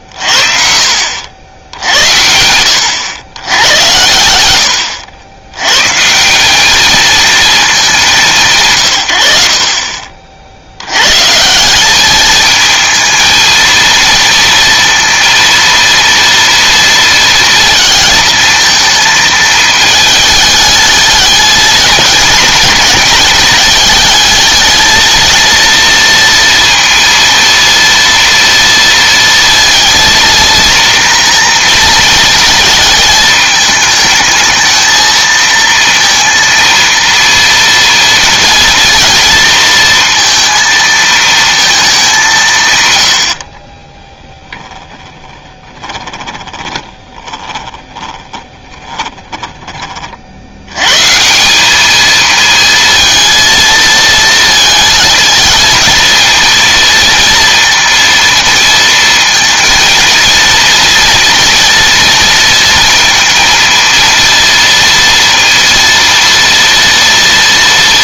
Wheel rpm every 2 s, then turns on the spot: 60, 90, 90, 210, 120, 90, 220, 230, 230, 230, 210, 220, 220, 230, 230, 230, 220, 220, 230, 230, 230, 130, 10, 20, 20, 100, 230, 220, 230, 230, 230, 230, 230, 230.
44-50